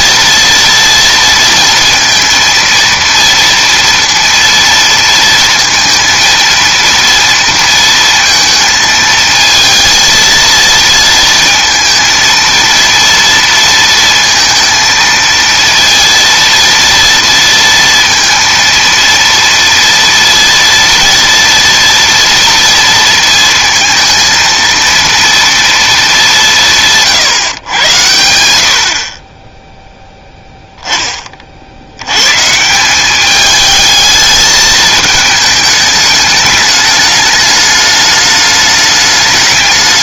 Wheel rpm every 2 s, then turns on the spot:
230, 230, 230, 230, 220, 230, 230, 220, 230, 230, 230, 230, 230, 170, 70, 10, 160, 220, 210, 210.
none